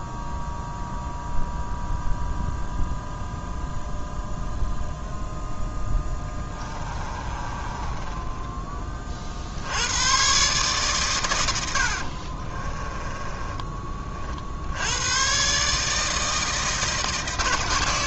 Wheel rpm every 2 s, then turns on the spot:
0, 0, 0, 20, 30, 130, 20, 80, 160.
6-8 12-14